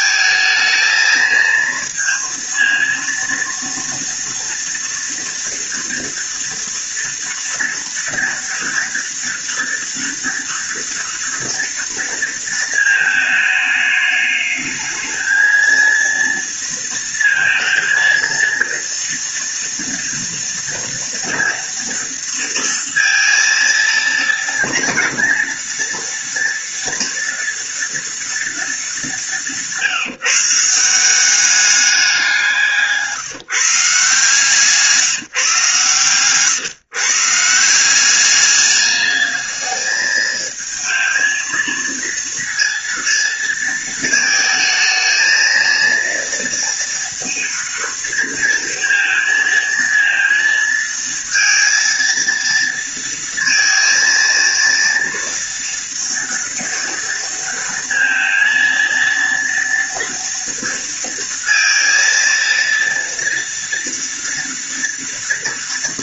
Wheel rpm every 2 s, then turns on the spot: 220, 230, 230, 230, 230, 230, 230, 210, 230, 230, 230, 230, 230, 230, 220, 160, 180, 150, 130, 200, 220, 230, 220, 230, 230, 230, 230, 230, 230, 230, 230, 230, 230.
34-36